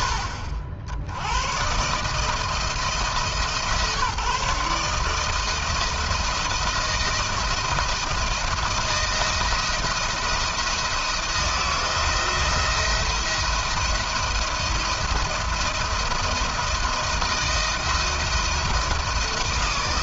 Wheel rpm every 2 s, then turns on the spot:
70, 160, 160, 170, 170, 170, 170, 170, 170, 170.
none